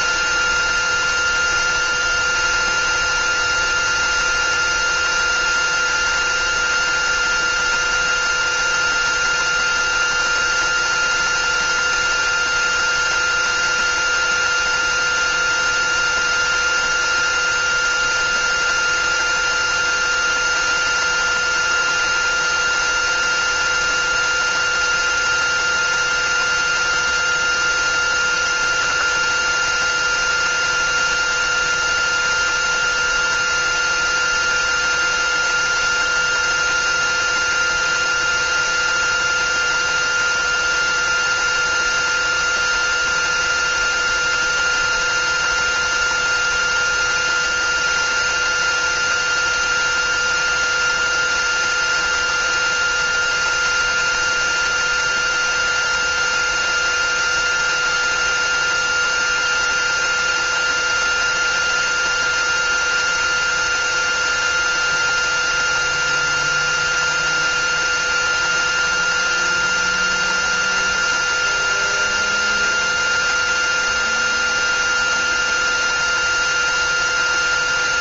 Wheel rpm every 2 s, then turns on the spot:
360, 360, 360, 360, 360, 360, 360, 360, 370, 360, 360, 360, 370, 360, 360, 360, 360, 360, 360, 360, 360, 370, 360, 360, 360, 360, 360, 360, 360, 360, 360, 360, 370, 370, 370, 360, 360, 370, 360.
none